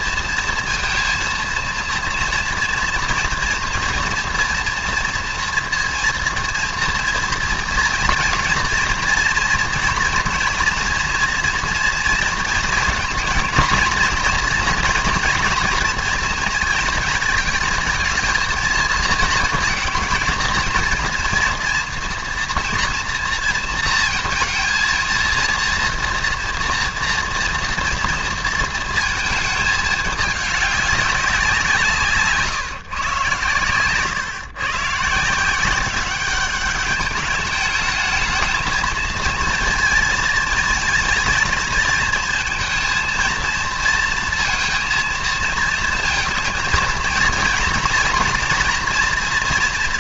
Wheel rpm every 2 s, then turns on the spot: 230, 230, 240, 230, 230, 230, 230, 230, 230, 220, 230, 230, 230, 230, 230, 210, 140, 140, 200, 220, 220, 230, 230, 230, 230.
none